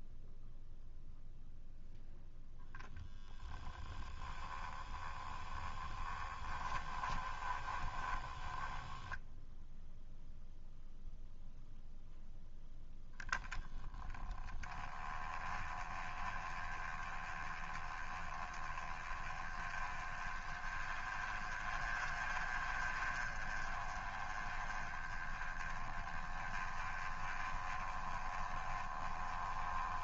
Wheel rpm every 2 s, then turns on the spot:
0, 0, 10, 20, 10, 0, 10, 20, 20, 20, 20, 30, 20, 20, 20.
4-10